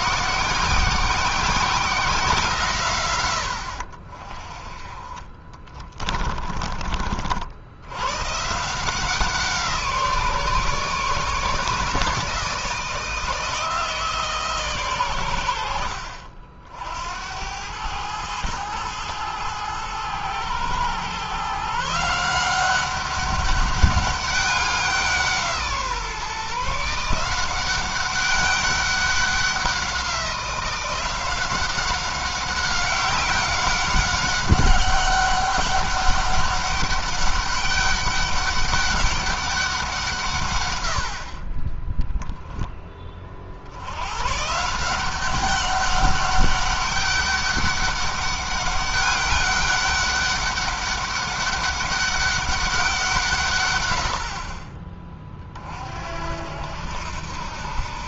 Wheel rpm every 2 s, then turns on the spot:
180, 140, 30, 40, 160, 150, 160, 120, 70, 110, 120, 190, 180, 160, 190, 180, 190, 190, 200, 200, 80, 20, 180, 200, 200, 200, 170, 30, 70.
4-6